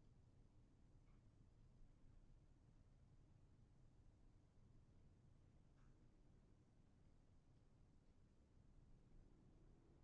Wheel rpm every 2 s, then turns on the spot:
0, 0, 0, 0, 0.
none